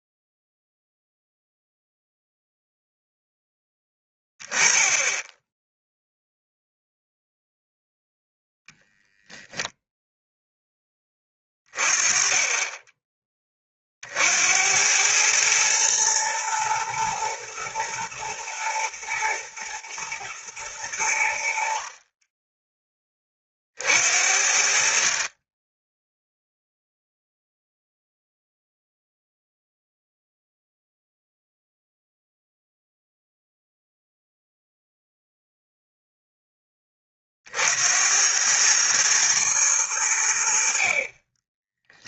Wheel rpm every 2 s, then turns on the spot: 0, 0, 20, 0, 10, 10, 10, 90, 110, 110, 100, 20, 60, 0, 0, 0, 0, 0, 20, 110, 50.
none